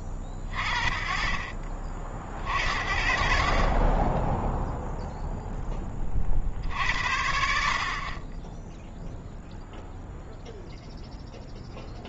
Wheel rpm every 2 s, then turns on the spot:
40, 50, 0, 60, 10, 0.
none